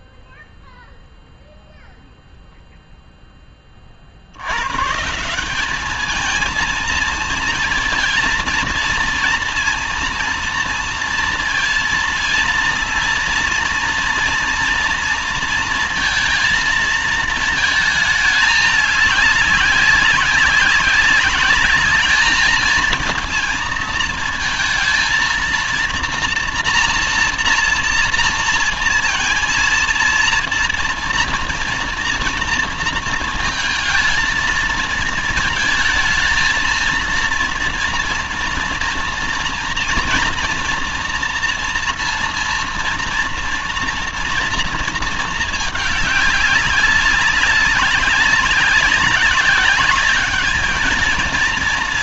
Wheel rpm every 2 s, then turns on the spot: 0, 0, 150, 220, 230, 230, 230, 230, 220, 210, 200, 220, 220, 230, 230, 230, 230, 220, 230, 230, 230, 230, 230, 200, 190, 220.
none